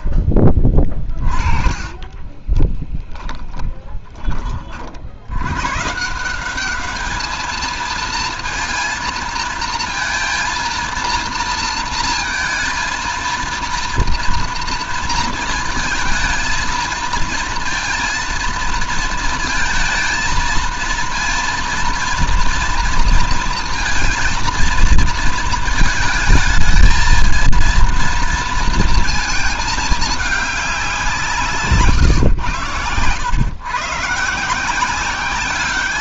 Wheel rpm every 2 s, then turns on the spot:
30, 20, 50, 200, 230, 230, 230, 230, 230, 230, 230, 230, 230, 220, 230, 200, 110, 170.
0-4